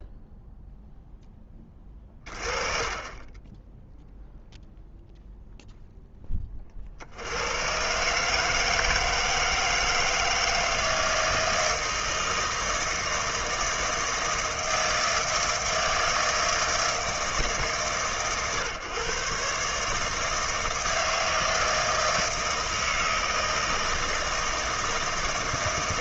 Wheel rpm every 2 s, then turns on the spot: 0, 30, 0, 30, 160, 160, 160, 160, 160, 130, 160, 160, 160.
none